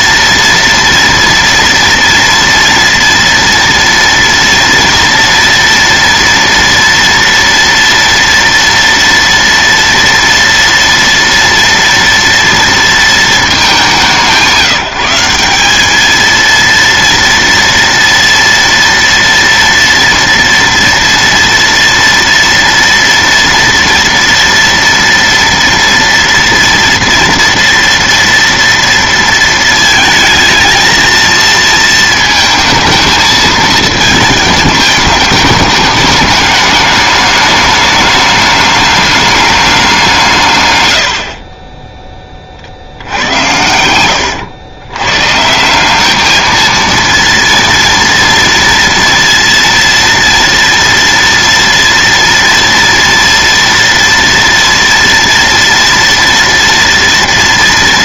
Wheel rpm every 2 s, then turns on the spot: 230, 230, 230, 230, 230, 230, 230, 170, 230, 230, 230, 230, 230, 230, 230, 220, 220, 210, 210, 200, 100, 60, 110, 230, 230, 230, 230, 230, 230.
none